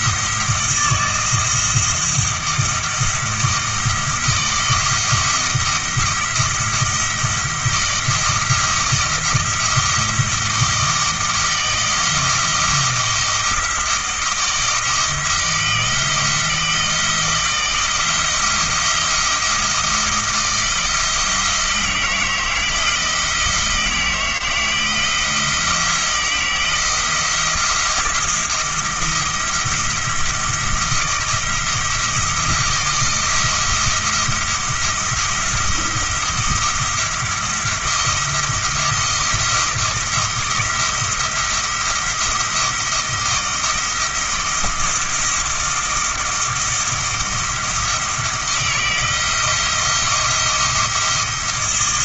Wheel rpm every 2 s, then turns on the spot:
170, 170, 170, 170, 170, 160, 170, 160, 170, 170, 160, 160, 160, 160, 170, 160, 170, 170, 170, 170, 170, 160, 160, 160, 160, 170.
none